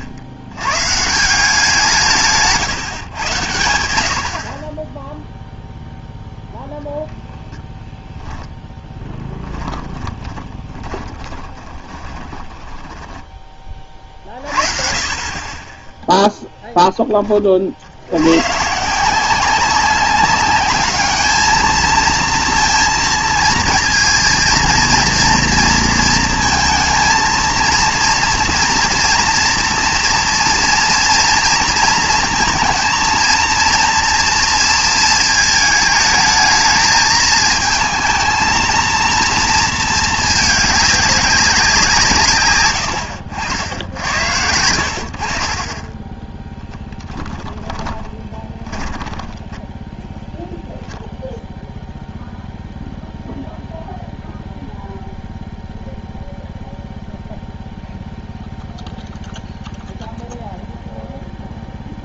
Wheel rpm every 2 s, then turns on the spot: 100, 150, 20, 0, 10, 30, 10, 30, 0, 130, 210, 230, 230, 220, 230, 230, 220, 230, 220, 230, 200, 110, 70, 20, 20, 10, 0, 0, 0, 0, 0.
8-14 46-50